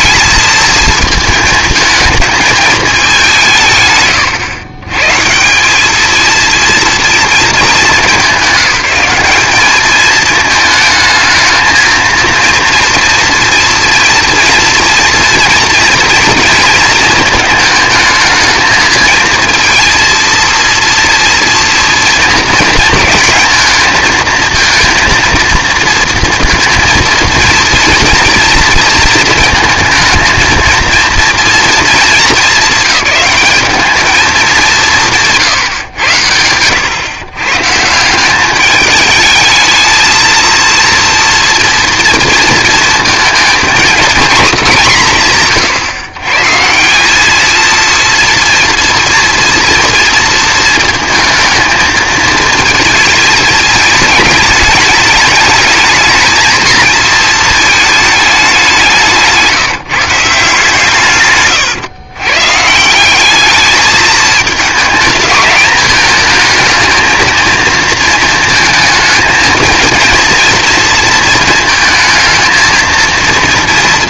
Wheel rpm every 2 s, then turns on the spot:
230, 220, 120, 230, 190, 220, 230, 240, 230, 220, 230, 220, 230, 230, 230, 230, 200, 190, 110, 200, 230, 230, 220, 150, 230, 220, 220, 210, 220, 190, 160, 180, 220, 230, 230, 230, 230.
none